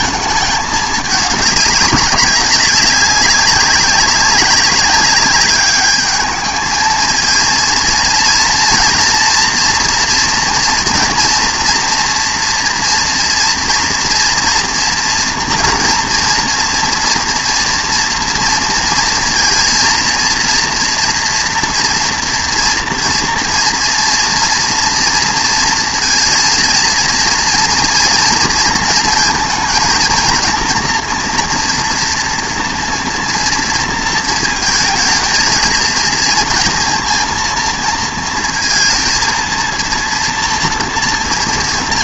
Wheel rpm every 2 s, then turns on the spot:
220, 200, 190, 220, 230, 230, 230, 230, 230, 230, 230, 230, 230, 230, 230, 230, 240, 220, 230, 230, 230.
none